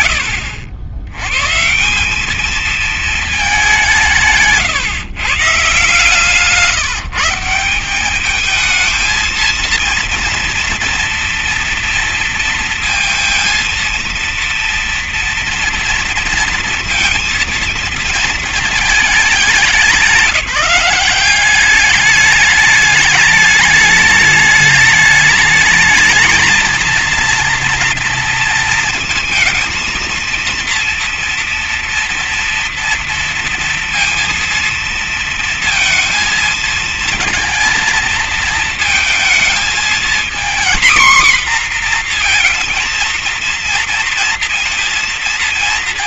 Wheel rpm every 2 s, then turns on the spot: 110, 210, 150, 170, 230, 230, 230, 240, 230, 200, 180, 210, 210, 230, 230, 230, 230, 230, 230, 230, 240, 230, 230.
none